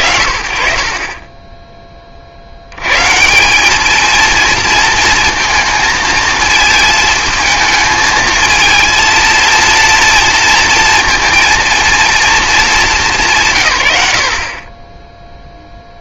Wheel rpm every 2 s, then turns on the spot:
40, 80, 230, 220, 220, 230, 210, 40.
none